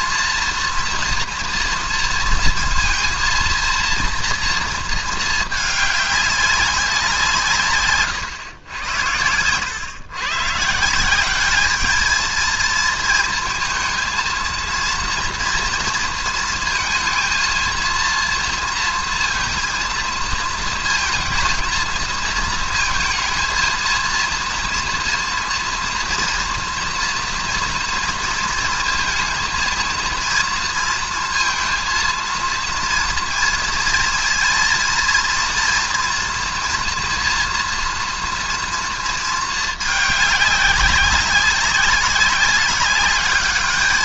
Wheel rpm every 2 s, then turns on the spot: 230, 230, 230, 200, 110, 150, 220, 230, 230, 230, 230, 230, 230, 230, 230, 230, 230, 230, 240, 240, 200, 200.
none